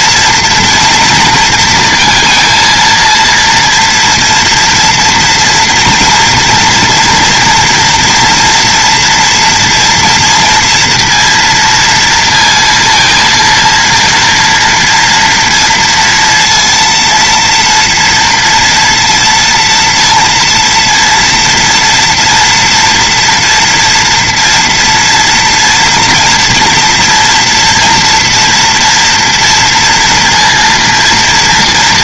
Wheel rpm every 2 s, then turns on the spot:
230, 230, 230, 230, 230, 230, 230, 230, 230, 230, 230, 230, 230, 240, 230, 230.
none